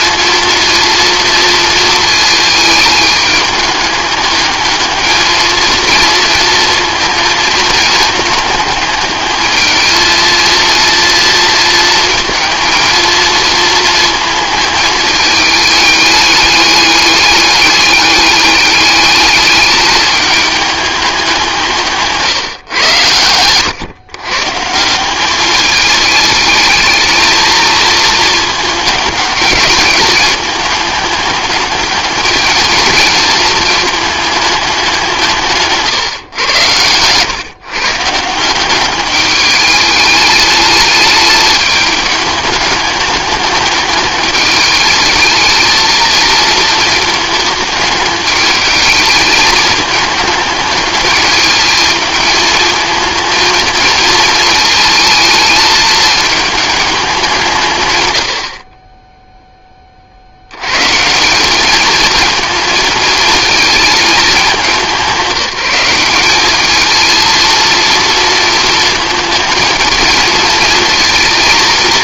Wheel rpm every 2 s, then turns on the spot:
230, 220, 210, 230, 220, 220, 230, 220, 210, 200, 210, 150, 120, 210, 220, 210, 220, 220, 120, 170, 210, 210, 210, 220, 220, 210, 220, 220, 220, 90, 70, 220, 210, 200, 230, 230.
none